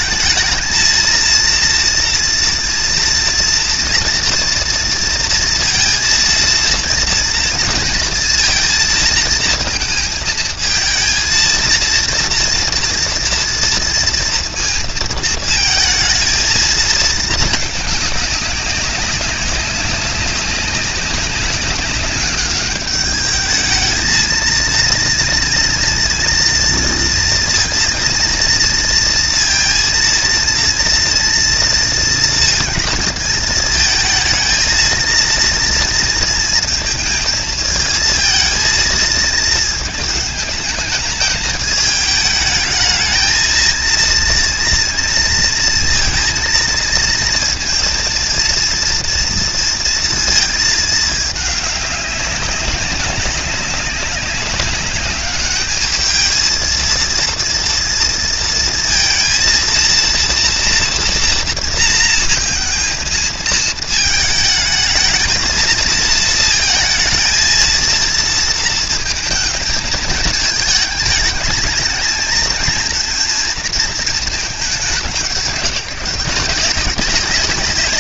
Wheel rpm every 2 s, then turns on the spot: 220, 230, 230, 230, 230, 230, 230, 230, 230, 200, 190, 200, 230, 230, 230, 230, 230, 220, 230, 220, 220, 220, 230, 230, 230, 220, 190, 200, 220, 230, 230, 230, 220, 220, 220, 210, 230, 210, 180.
none